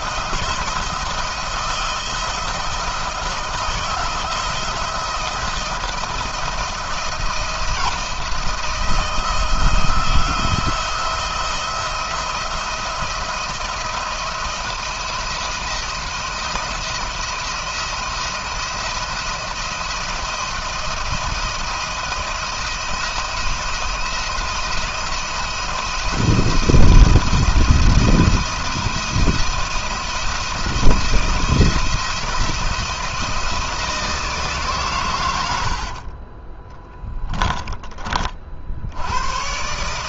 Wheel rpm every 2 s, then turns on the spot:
170, 170, 170, 170, 160, 170, 170, 160, 170, 170, 170, 170, 170, 170, 170, 170, 160, 120, 10, 80.
36-38